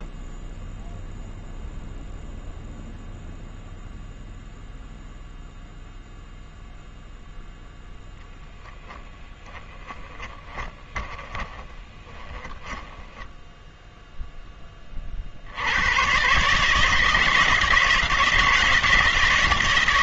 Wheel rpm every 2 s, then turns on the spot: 0, 0, 0, 0, 20, 10, 10, 20, 150, 170.
8-14